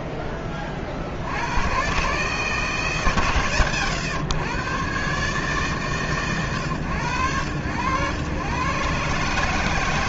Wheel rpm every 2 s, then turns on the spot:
70, 130, 130, 90, 140.
none